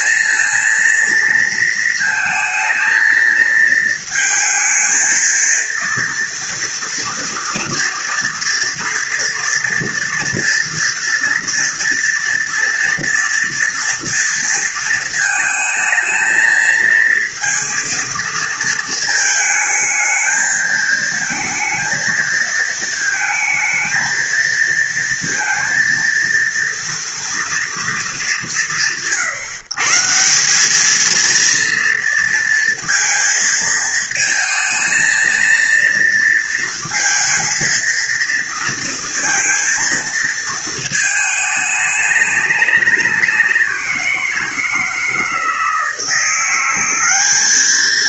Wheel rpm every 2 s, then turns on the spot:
230, 230, 220, 230, 230, 230, 230, 230, 230, 220, 220, 220, 230, 230, 140, 200, 230, 220, 230, 230, 220, 190, 160, 190.
none